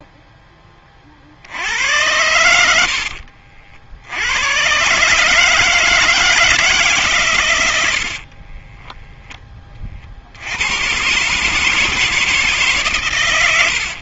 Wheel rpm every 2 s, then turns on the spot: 10, 90, 110, 150, 30, 80, 150.
8-10